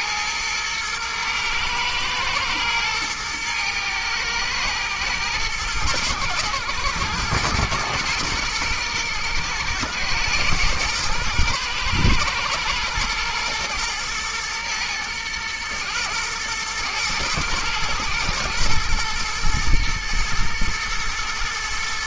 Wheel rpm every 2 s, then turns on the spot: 110, 120, 110, 110, 120, 110, 110, 110, 120, 120, 120.
none